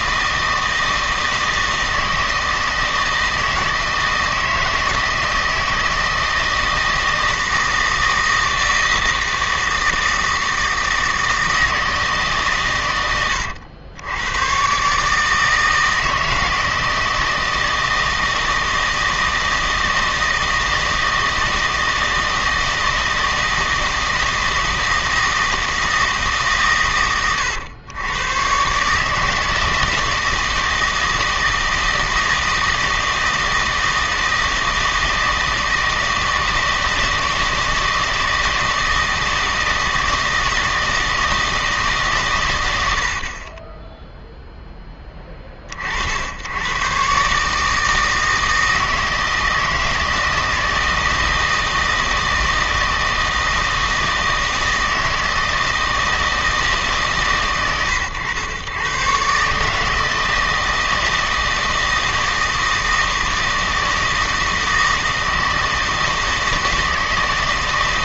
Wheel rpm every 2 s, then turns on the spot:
160, 160, 160, 160, 160, 160, 120, 130, 160, 160, 160, 160, 160, 120, 130, 160, 160, 160, 160, 160, 160, 100, 10, 110, 160, 160, 160, 160, 160, 110, 160, 160, 160, 160.
none